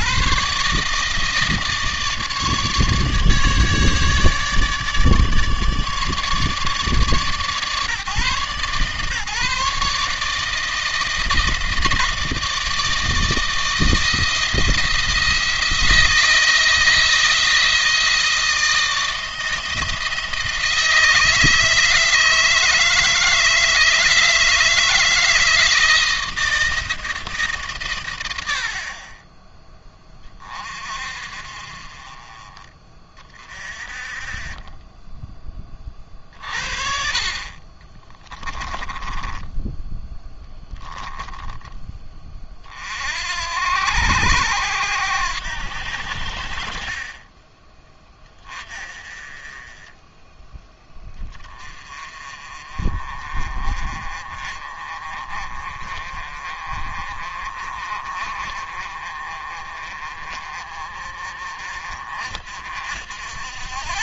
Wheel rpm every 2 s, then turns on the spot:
160, 150, 150, 150, 140, 160, 160, 170, 160, 160, 170, 160, 170, 160, 60, 40, 30, 20, 50, 10, 10, 30, 90, 50, 30, 10, 30, 30, 30, 40, 40, 60.
38-42